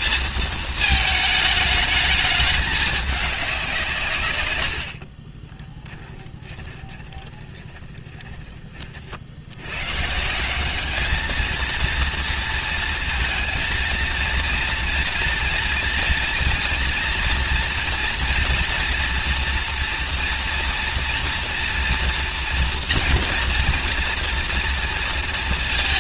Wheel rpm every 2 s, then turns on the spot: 220, 210, 110, 20, 30, 190, 230, 230, 230, 240, 240, 240, 230.
6-8